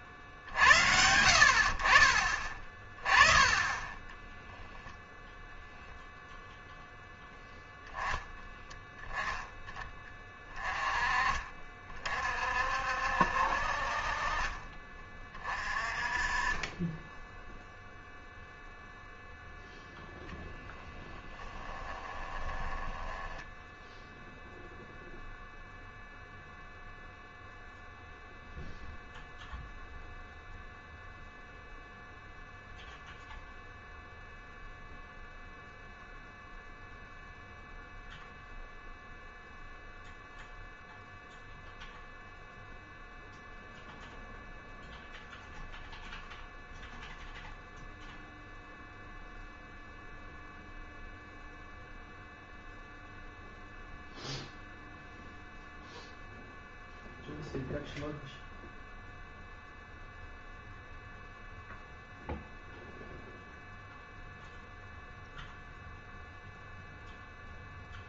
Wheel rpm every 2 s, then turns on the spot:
70, 20, 0, 10, 10, 40, 70, 30, 20, 0, 10, 10, 0, 0, 0, 0, 0, 0, 0, 0, 0, 0, 0, 0, 0, 0, 0, 0, 0, 0, 0, 0, 0, 0.
2-4 20-24